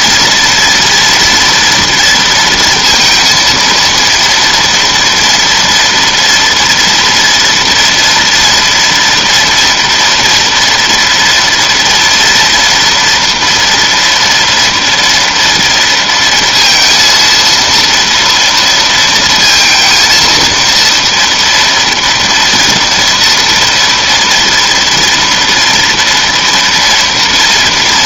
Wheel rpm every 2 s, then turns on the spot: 230, 230, 230, 230, 230, 240, 230, 230, 230, 230, 230, 230, 230, 230.
none